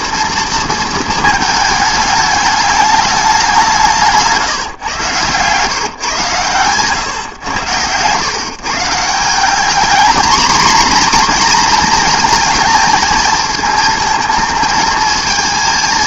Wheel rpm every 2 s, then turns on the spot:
220, 200, 120, 120, 160, 240, 220, 220.
none